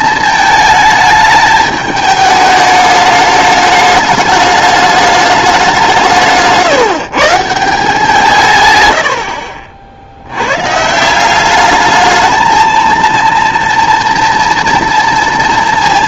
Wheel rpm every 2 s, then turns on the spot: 220, 210, 210, 150, 120, 130, 230, 230.
none